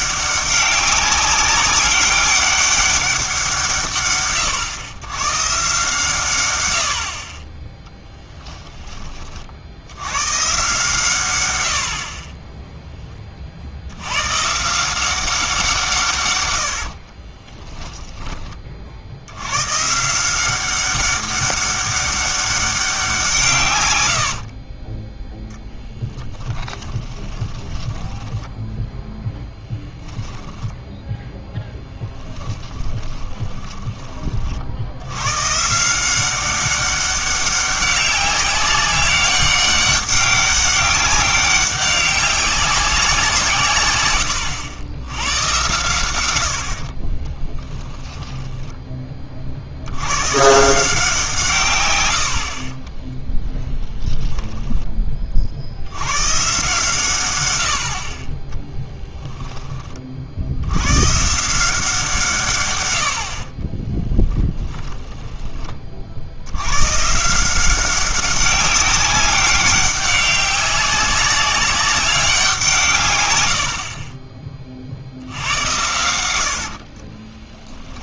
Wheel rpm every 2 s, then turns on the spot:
200, 200, 110, 80, 10, 140, 10, 160, 90, 30, 190, 200, 40, 10, 0, 10, 20, 60, 190, 190, 200, 190, 80, 90, 10, 150, 40, 10, 140, 10, 90, 110, 10, 100, 190, 190, 170, 40, 70.
16-18 24-28 32-34 48-50 58-60 64-66 76-78